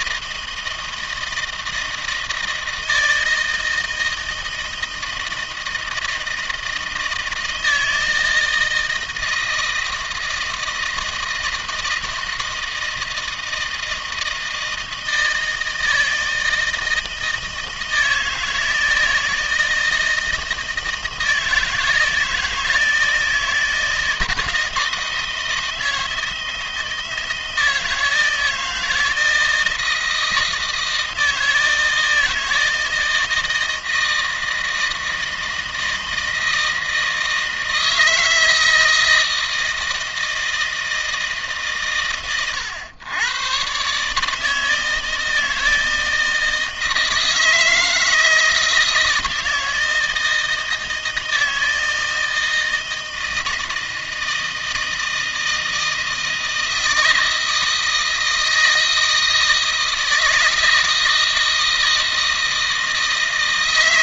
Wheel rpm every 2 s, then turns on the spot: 160, 160, 160, 160, 160, 160, 160, 160, 160, 160, 160, 160, 160, 160, 160, 160, 160, 160, 160, 160, 160, 100, 150, 160, 160, 160, 160, 160, 160, 160, 160, 160.
none